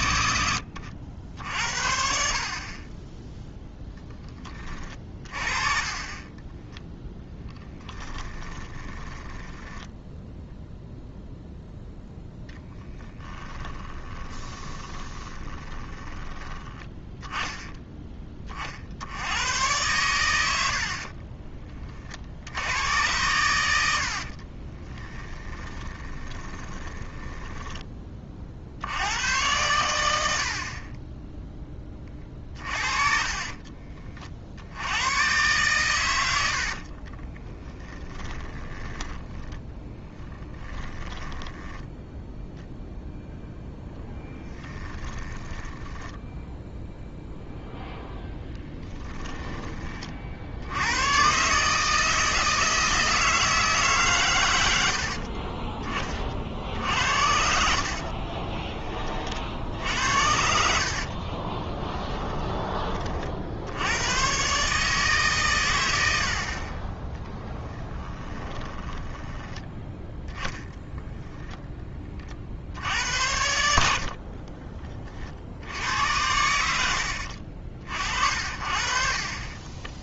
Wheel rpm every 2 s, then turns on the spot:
80, 30, 30, 10, 20, 0, 20, 20, 10, 50, 60, 100, 20, 20, 60, 40, 40, 80, 50, 20, 10, 0, 10, 0, 10, 100, 160, 80, 70, 30, 60, 30, 150, 30, 20, 10, 70, 30, 70, 40.
6-10 12-16 24-28 32-34 36-42 44-46 48-50 56-58 60-62 68-70